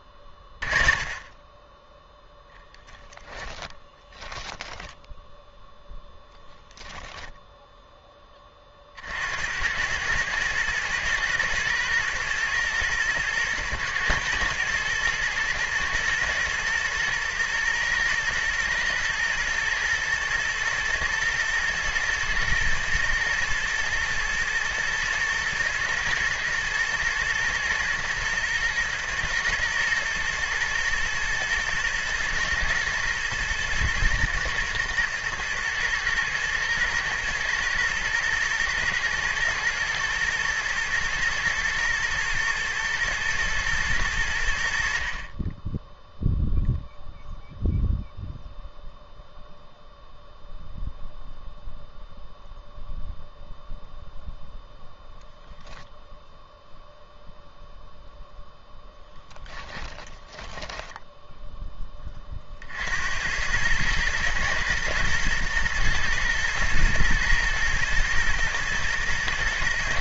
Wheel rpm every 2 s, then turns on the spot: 20, 10, 10, 0, 40, 110, 120, 110, 120, 110, 110, 110, 120, 110, 120, 110, 110, 110, 110, 110, 120, 110, 60, 0, 0, 0, 0, 0, 0, 0, 10, 60, 110, 120, 110.
60-62